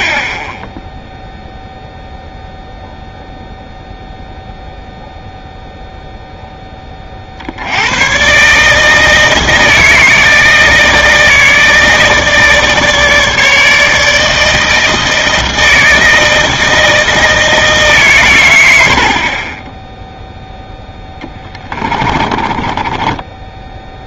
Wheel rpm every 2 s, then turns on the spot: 0, 0, 0, 10, 160, 160, 150, 160, 160, 80, 10, 20.
22-24